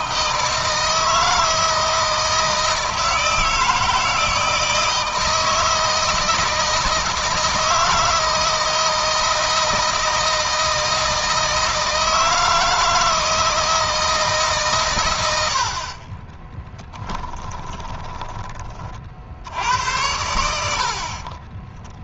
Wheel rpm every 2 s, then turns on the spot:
160, 160, 160, 160, 160, 160, 160, 130, 10, 30, 70.
16-18